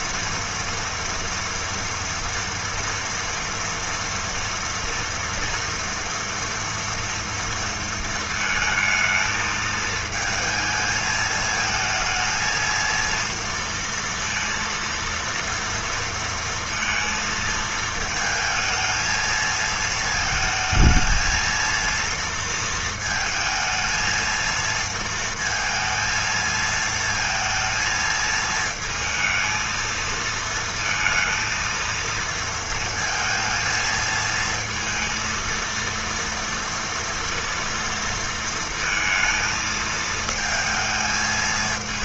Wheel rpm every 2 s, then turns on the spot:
230, 230, 230, 230, 220, 220, 220, 230, 230, 220, 220, 230, 230, 220, 220, 230, 230, 220, 230, 230, 220.
none